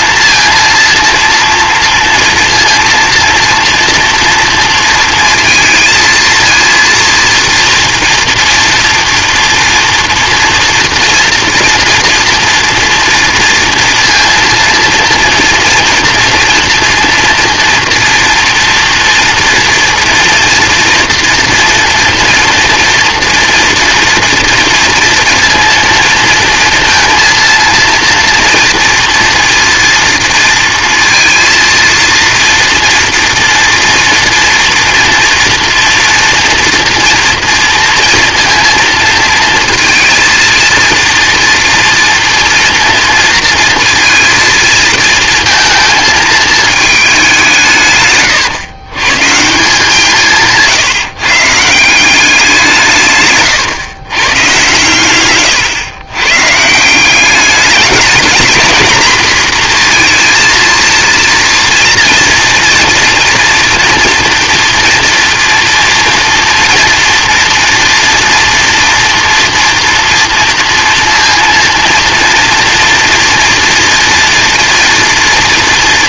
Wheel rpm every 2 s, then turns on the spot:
230, 230, 230, 230, 230, 230, 230, 230, 230, 230, 230, 230, 230, 230, 230, 230, 230, 240, 230, 230, 230, 240, 230, 220, 110, 150, 170, 120, 140, 220, 230, 230, 230, 230, 230, 230, 240, 230.
none